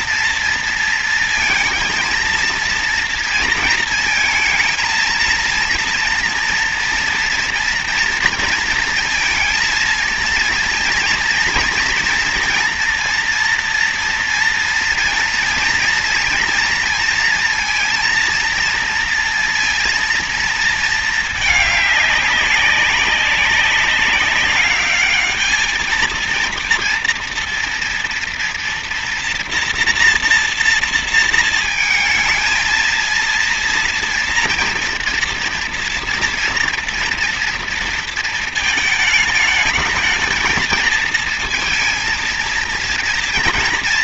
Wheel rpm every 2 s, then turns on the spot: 230, 230, 230, 230, 230, 230, 240, 230, 230, 230, 230, 200, 210, 230, 230, 230, 230, 230, 230, 220, 220, 230.
none